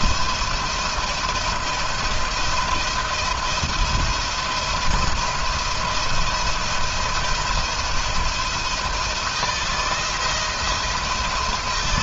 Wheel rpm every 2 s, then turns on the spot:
170, 170, 170, 170, 170, 170.
none